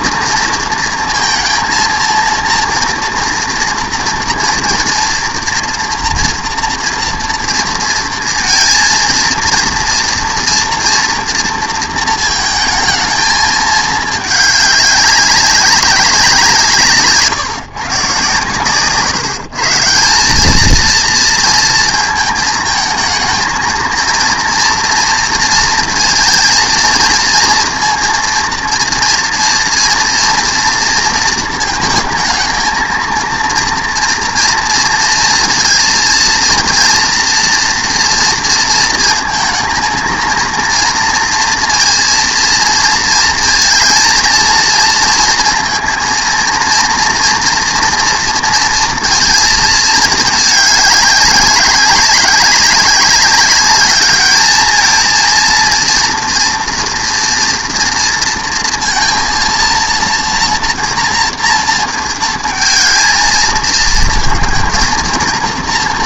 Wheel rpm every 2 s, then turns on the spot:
230, 230, 230, 230, 230, 230, 220, 210, 150, 140, 220, 220, 230, 230, 230, 230, 230, 230, 230, 230, 230, 230, 230, 230, 230, 210, 190, 220, 230, 230, 230, 230, 230.
none